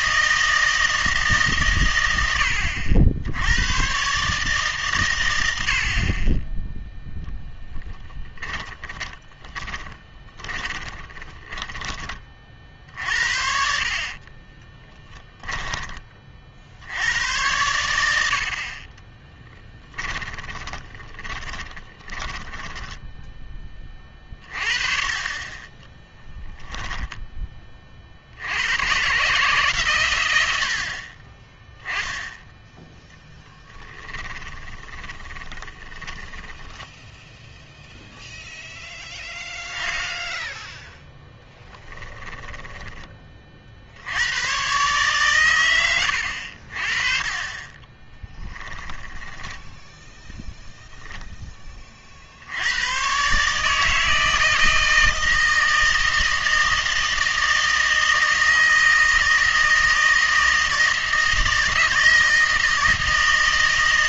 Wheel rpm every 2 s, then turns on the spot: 160, 80, 140, 10, 20, 30, 60, 20, 60, 40, 20, 10, 30, 10, 100, 70, 0, 20, 10, 0, 0, 10, 120, 50, 10, 10, 90, 160, 160, 160, 160, 160.
8-12 14-16 20-24 34-38 42-44 48-50